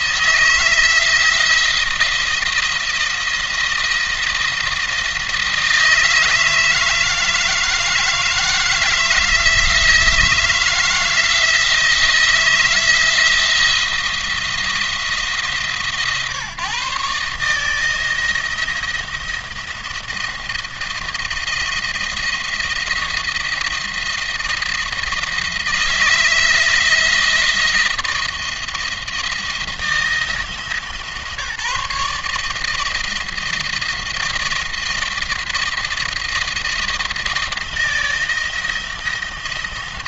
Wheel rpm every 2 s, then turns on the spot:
160, 170, 170, 160, 160, 170, 160, 170, 150, 170, 170, 170, 170, 160, 170, 150, 150, 170, 170, 170.
none